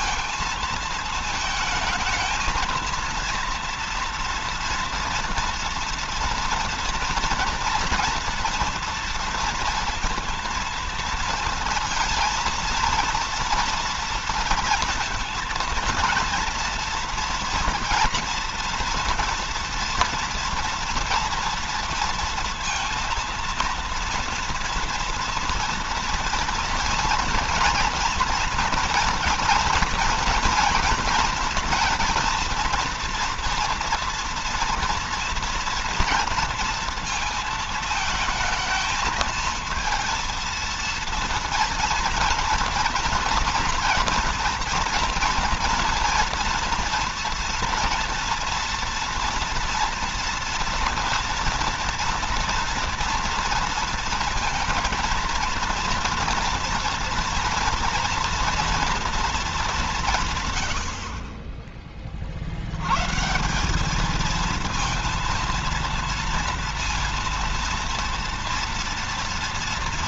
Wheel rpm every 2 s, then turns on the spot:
220, 230, 230, 240, 230, 230, 230, 230, 230, 230, 230, 230, 240, 230, 230, 230, 230, 230, 230, 220, 230, 230, 230, 230, 230, 240, 230, 230, 240, 230, 90, 110, 230, 230, 230.
none